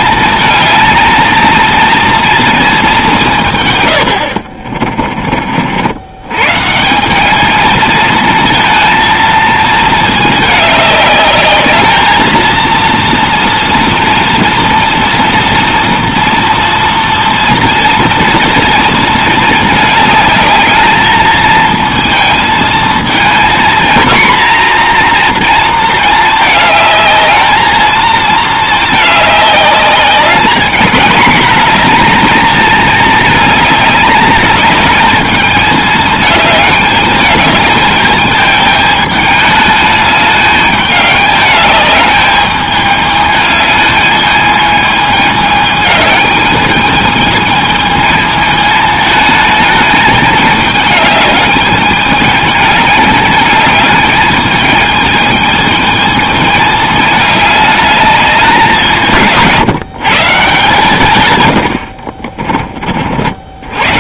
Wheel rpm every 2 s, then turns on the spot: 220, 220, 50, 160, 230, 210, 230, 230, 230, 230, 220, 230, 240, 220, 220, 220, 220, 210, 210, 210, 210, 210, 220, 210, 220, 210, 210, 220, 210, 180, 160, 50.
4-6